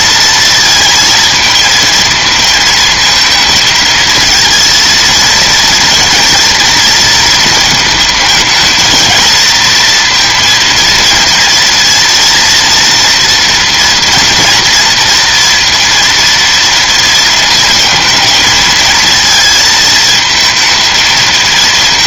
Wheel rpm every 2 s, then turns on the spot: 230, 220, 230, 240, 220, 230, 230, 230, 230, 220, 220.
none